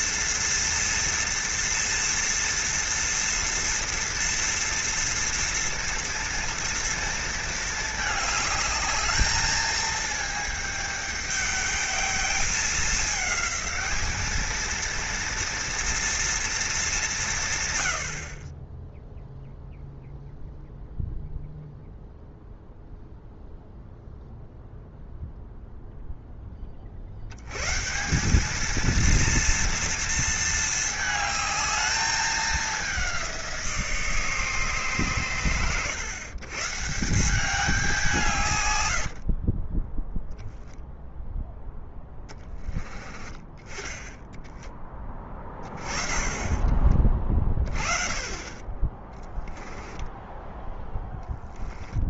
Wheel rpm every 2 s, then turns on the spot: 230, 230, 230, 230, 210, 210, 210, 230, 210, 10, 0, 0, 0, 50, 230, 220, 200, 130, 160, 90, 0, 20, 10, 30, 20, 10.
38-40 50-52